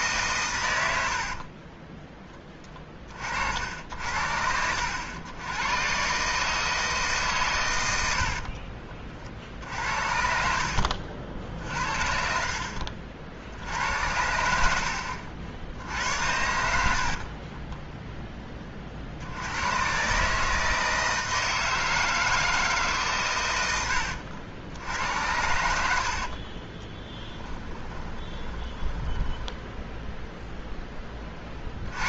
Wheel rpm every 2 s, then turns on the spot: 110, 20, 80, 160, 50, 60, 60, 70, 70, 30, 160, 160, 80, 30, 20, 0.
8-14 16-18 26-30